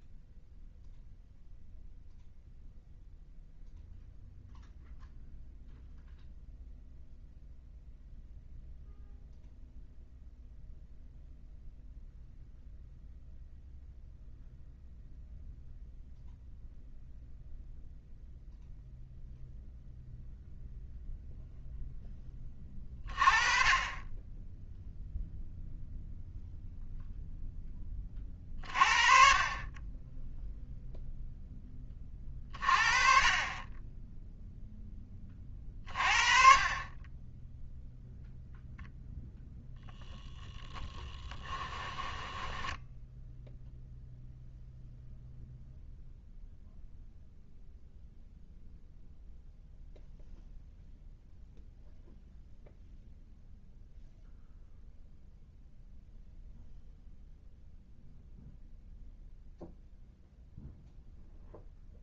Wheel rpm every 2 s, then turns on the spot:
0, 0, 0, 0, 0, 0, 0, 0, 0, 0, 0, 30, 0, 0, 40, 0, 30, 0, 30, 0, 20, 10, 0, 0, 0, 0, 0, 0, 0, 0, 0.
40-44